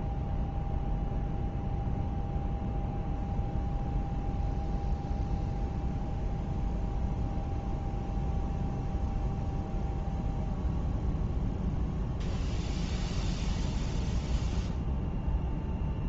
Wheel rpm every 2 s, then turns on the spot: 0, 0, 0, 0, 0, 0, 0, 0.
none